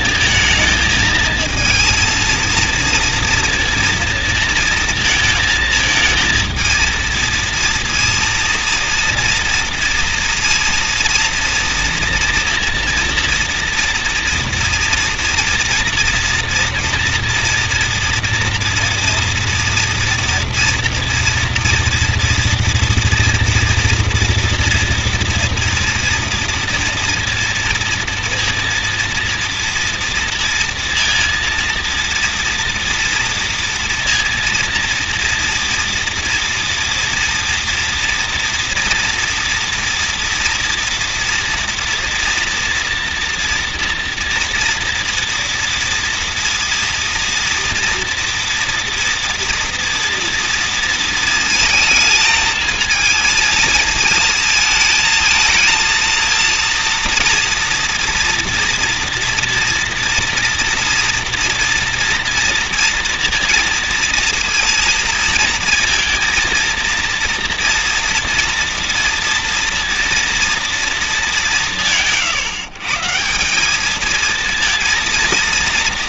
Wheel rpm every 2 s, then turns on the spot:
220, 230, 230, 230, 230, 230, 230, 230, 240, 240, 240, 230, 240, 240, 230, 230, 230, 230, 230, 230, 230, 240, 230, 230, 230, 230, 230, 220, 230, 230, 230, 230, 230, 230, 230, 230, 130, 230.
none